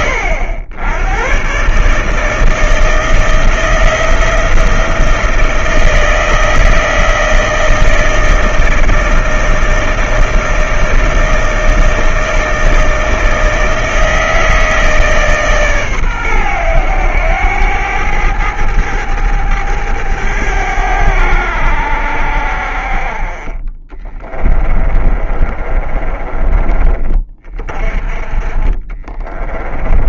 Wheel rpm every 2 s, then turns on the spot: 100, 160, 170, 160, 160, 160, 160, 160, 110, 100, 90, 50, 20, 30, 30.
24-26 28-30